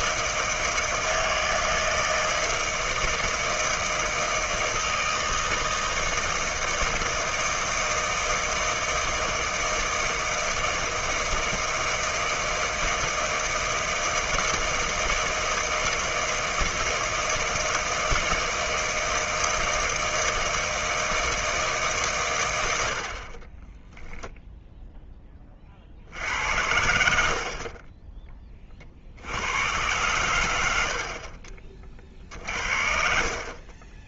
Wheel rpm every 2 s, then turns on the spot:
160, 160, 160, 160, 160, 160, 160, 160, 160, 160, 160, 70, 0, 80, 50, 70, 50.
none